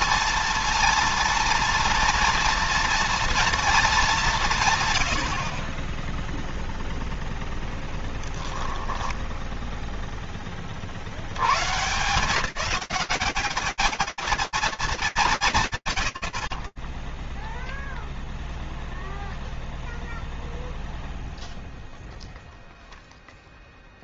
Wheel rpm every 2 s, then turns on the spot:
230, 230, 120, 0, 10, 50, 180, 110, 0, 0, 10, 10.
8-10